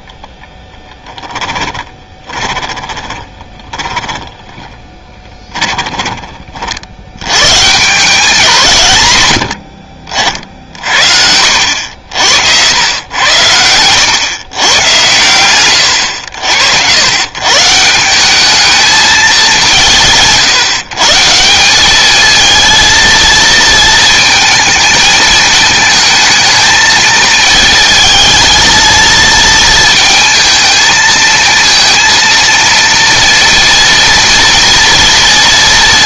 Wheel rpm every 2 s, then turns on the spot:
10, 30, 20, 60, 150, 60, 90, 120, 90, 210, 140, 230, 220, 220, 230, 220, 230, 230.
0-6